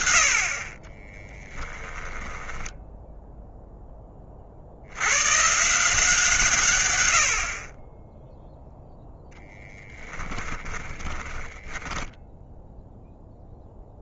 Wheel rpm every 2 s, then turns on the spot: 40, 10, 80, 130, 0, 10, 0.
2-4 10-12